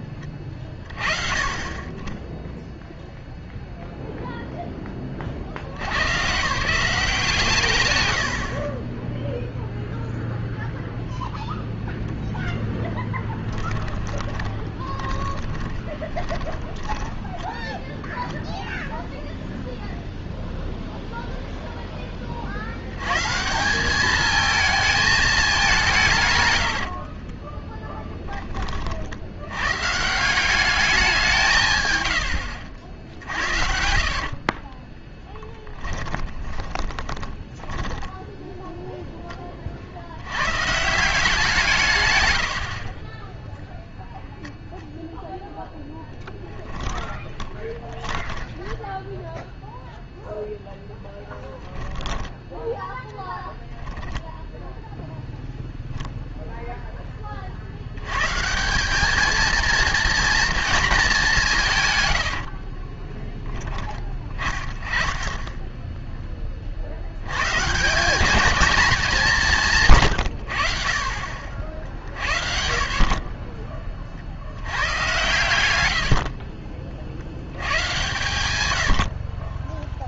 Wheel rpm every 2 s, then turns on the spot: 20, 0, 30, 180, 30, 0, 10, 20, 10, 0, 0, 110, 220, 70, 60, 200, 70, 20, 30, 0, 160, 50, 0, 10, 10, 0, 10, 0, 10, 200, 230, 40, 30, 60, 210, 50, 60, 110, 50, 90.
14-18 26-28 32-38 46-50 52-54 62-64